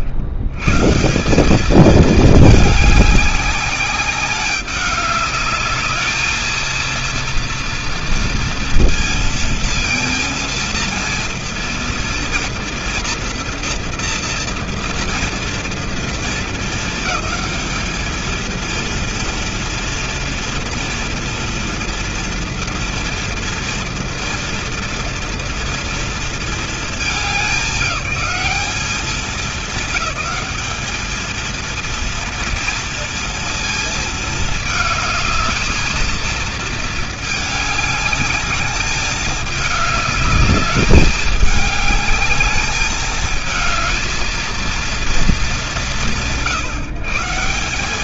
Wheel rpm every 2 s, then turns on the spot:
100, 210, 200, 230, 230, 230, 230, 230, 220, 230, 230, 230, 230, 210, 200, 210, 230, 220, 220, 210, 210, 220, 230, 130.
none